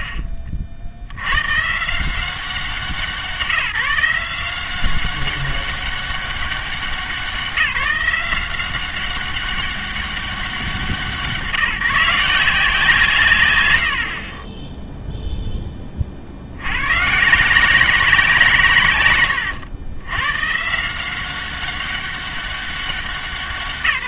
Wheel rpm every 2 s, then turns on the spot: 60, 180, 180, 190, 180, 180, 160, 10, 100, 140, 150, 190.
none